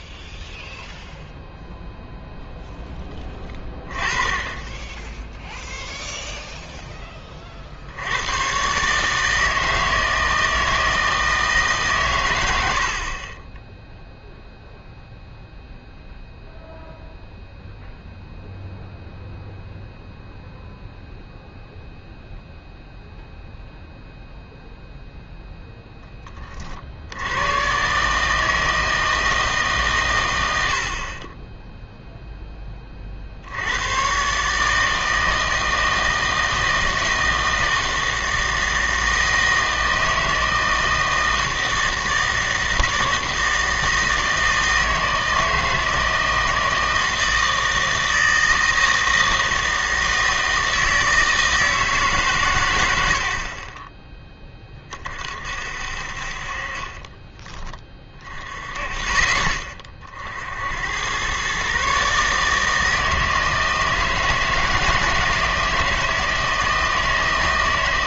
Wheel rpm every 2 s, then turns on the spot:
0, 10, 10, 10, 140, 160, 70, 0, 0, 0, 0, 0, 0, 50, 160, 70, 20, 150, 160, 160, 160, 160, 160, 160, 160, 160, 110, 30, 30, 40, 80, 160, 160, 160.
56-58